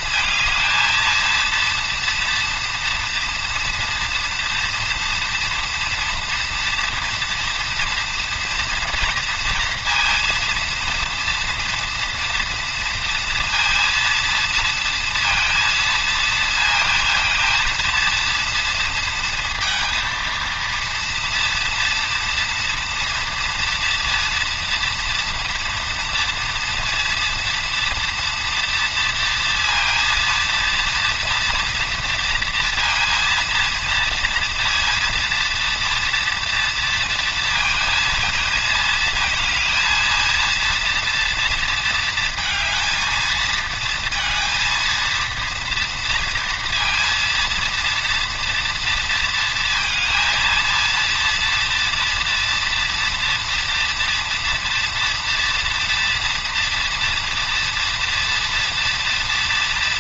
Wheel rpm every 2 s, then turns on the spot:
230, 230, 240, 230, 230, 230, 230, 230, 220, 230, 230, 230, 230, 230, 230, 230, 230, 230, 230, 220, 230, 230, 230, 230, 230, 230, 230, 240, 230, 230.
none